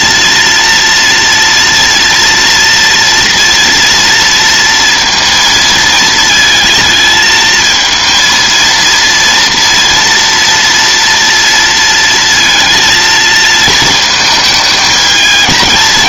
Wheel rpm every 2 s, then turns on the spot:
230, 230, 230, 220, 230, 230, 230, 220.
none